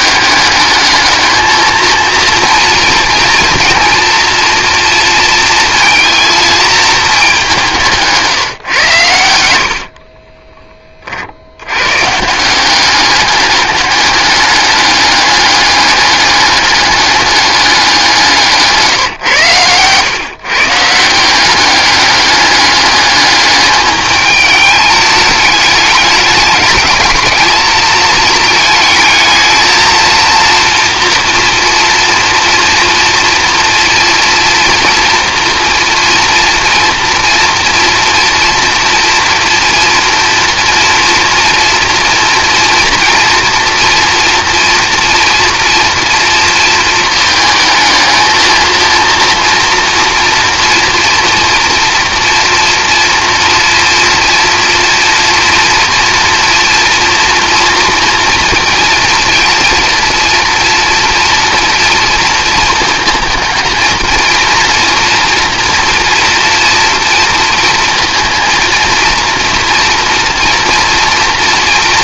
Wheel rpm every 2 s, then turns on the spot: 210, 230, 230, 220, 120, 30, 190, 200, 200, 150, 160, 200, 210, 210, 220, 230, 230, 230, 230, 230, 230, 240, 230, 220, 230, 230, 240, 230, 230, 230, 240, 230, 240, 230, 230, 230.
18-20